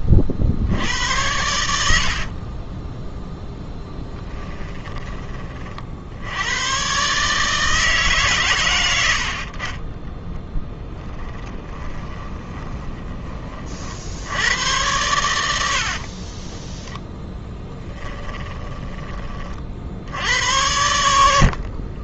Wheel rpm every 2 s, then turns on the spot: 80, 20, 10, 120, 90, 10, 30, 100, 10, 20, 80.
2-4 10-14 16-18